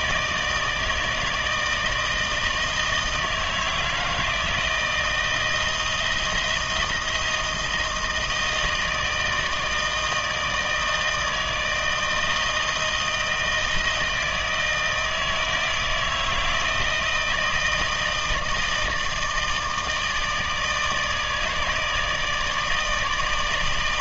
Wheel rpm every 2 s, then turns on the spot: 160, 160, 160, 160, 160, 160, 160, 160, 160, 160, 160, 160.
none